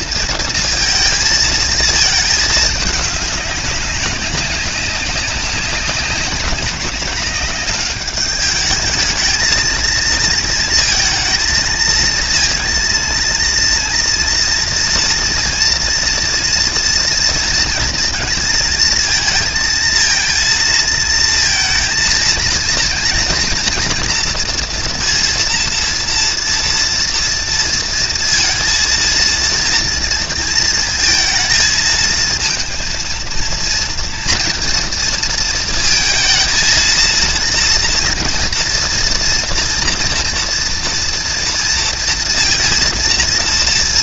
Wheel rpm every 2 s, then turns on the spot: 230, 210, 200, 190, 210, 220, 230, 230, 230, 230, 230, 230, 230, 230, 230, 230, 220, 230, 230, 230, 230, 230.
none